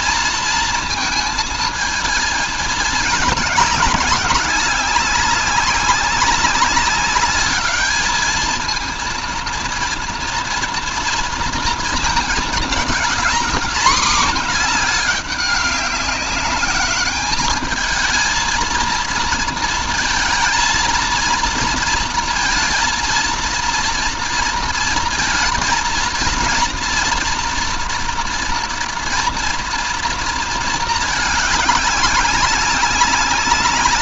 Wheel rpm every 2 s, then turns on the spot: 230, 220, 190, 190, 220, 230, 220, 230, 200, 220, 230, 230, 230, 230, 230, 230, 200.
none